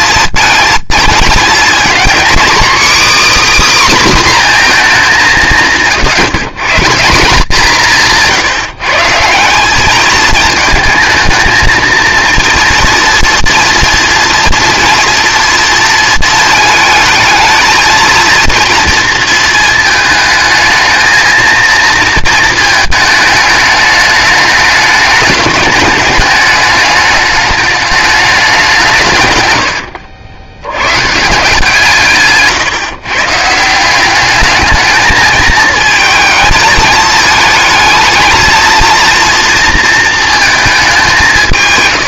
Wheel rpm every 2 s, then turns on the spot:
220, 270, 250, 150, 160, 220, 230, 240, 230, 230, 220, 230, 210, 210, 200, 90, 140, 210, 230, 230, 220.
none